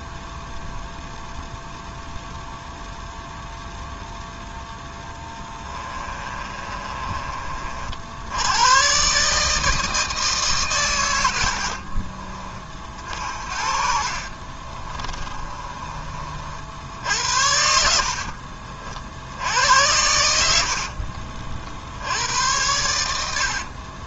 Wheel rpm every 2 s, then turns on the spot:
0, 0, 10, 30, 130, 110, 50, 30, 70, 50, 40, 90.
4-8 14-18 20-24